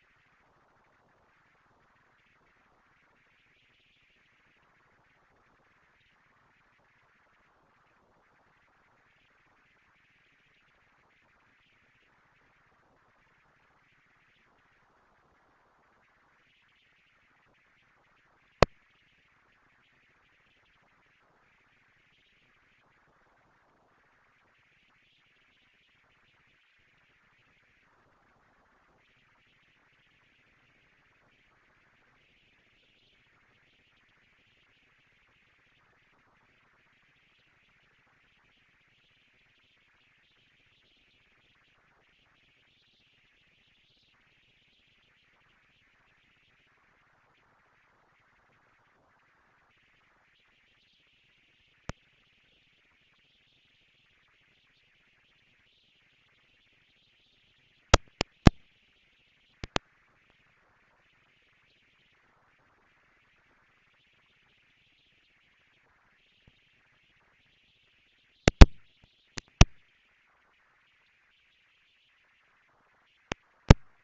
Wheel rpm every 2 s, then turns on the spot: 200, 230, 230, 230, 230, 230, 230, 230, 230, 230, 230, 230, 230, 230, 220, 170, 170, 210, 220, 220, 220, 230, 230, 230, 230, 220, 230, 230, 220, 230, 240, 230, 230, 230, 230, 230, 220.
none